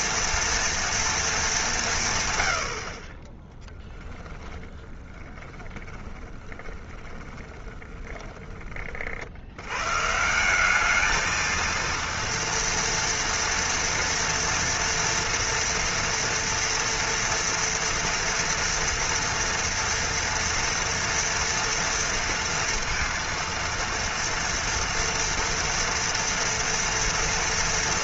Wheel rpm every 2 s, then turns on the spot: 230, 100, 10, 20, 20, 190, 230, 230, 230, 230, 230, 230, 230, 230.
4-8